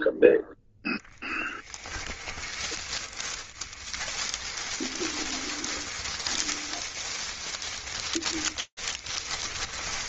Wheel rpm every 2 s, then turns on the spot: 0, 20, 20, 20, 20.
2-10